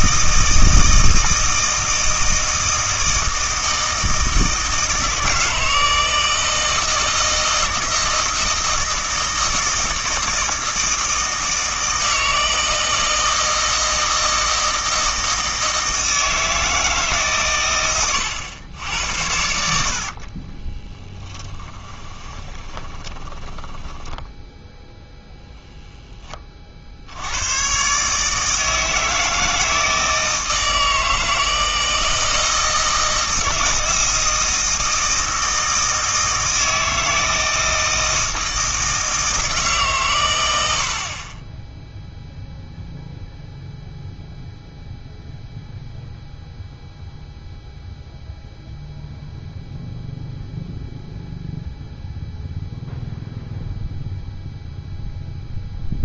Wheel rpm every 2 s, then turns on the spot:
160, 160, 160, 160, 160, 160, 160, 160, 160, 100, 30, 30, 0, 50, 160, 160, 160, 160, 160, 160, 80, 0, 0, 0, 0, 0, 0, 0.
20-24